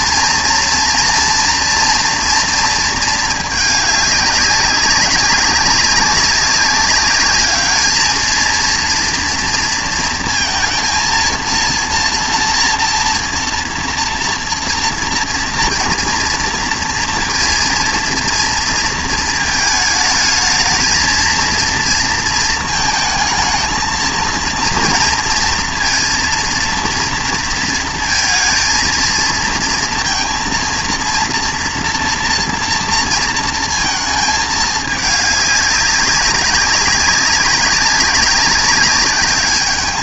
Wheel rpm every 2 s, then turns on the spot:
230, 230, 200, 200, 230, 230, 230, 230, 230, 230, 220, 220, 230, 230, 230, 230, 230, 220, 190, 190.
none